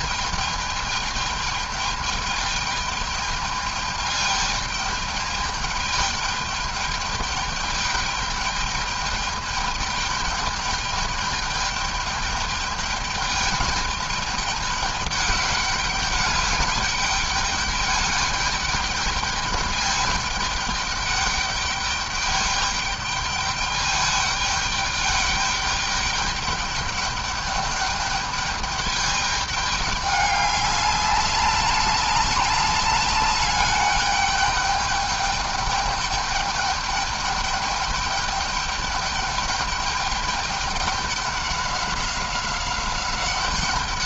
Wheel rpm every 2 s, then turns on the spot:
220, 210, 210, 210, 210, 210, 210, 210, 200, 210, 210, 210, 210, 210, 210, 200, 200, 210, 210, 210, 200, 190.
none